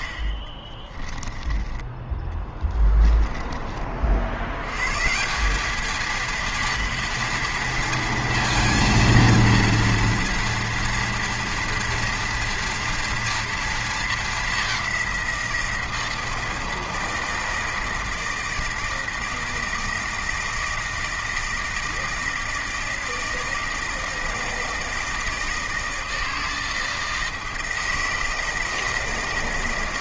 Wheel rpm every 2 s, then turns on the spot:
20, 20, 110, 230, 230, 240, 240, 200, 160, 160, 160, 160, 160, 160, 160.
0-4